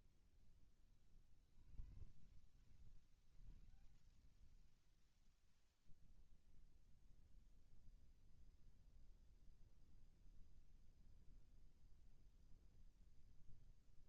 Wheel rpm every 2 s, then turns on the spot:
30, 80, 10, 0, 0, 0, 0.
none